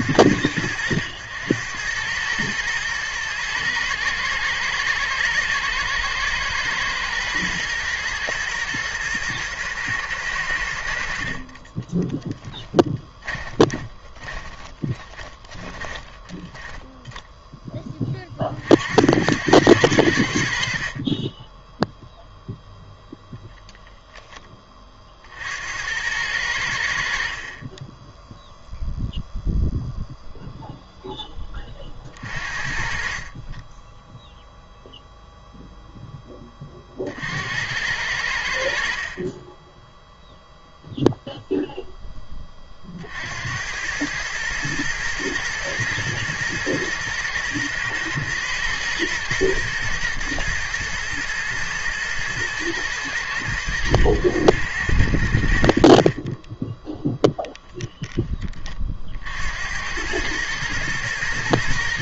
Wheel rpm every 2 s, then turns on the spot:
90, 110, 120, 120, 110, 80, 10, 20, 20, 50, 50, 0, 10, 80, 0, 0, 40, 0, 30, 50, 0, 30, 110, 120, 110, 120, 110, 90, 10, 30, 110.
12-18